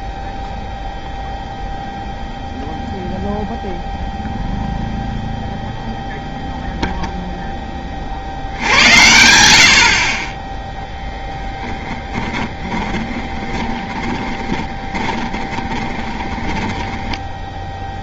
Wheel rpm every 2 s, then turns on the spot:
0, 0, 0, 0, 80, 0, 20, 20, 10.
12-18